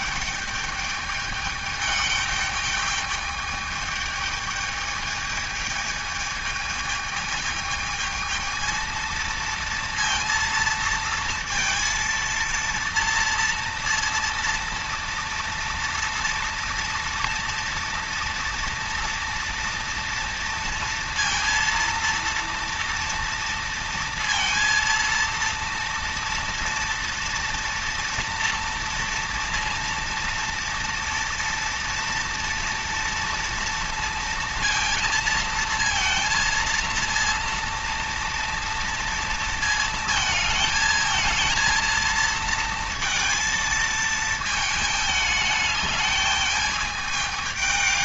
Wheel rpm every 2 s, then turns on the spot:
210, 210, 210, 220, 220, 230, 230, 230, 230, 230, 230, 230, 230, 230, 230, 230, 240, 230, 230, 230, 220, 230, 220, 210.
none